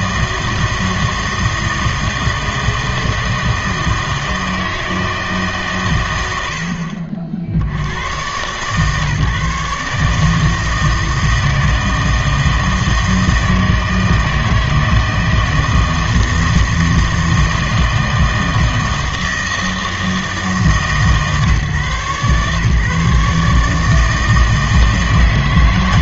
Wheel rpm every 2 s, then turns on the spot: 160, 160, 160, 70, 130, 160, 160, 160, 160, 160, 160, 140, 160.
none